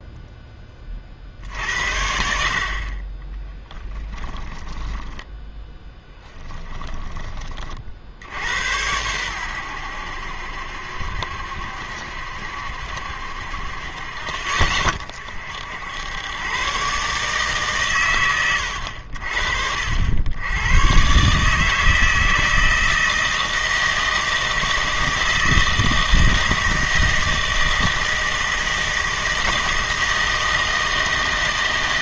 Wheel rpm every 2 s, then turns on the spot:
30, 40, 10, 10, 100, 70, 70, 40, 120, 90, 110, 160, 160, 160, 160, 160.
4-8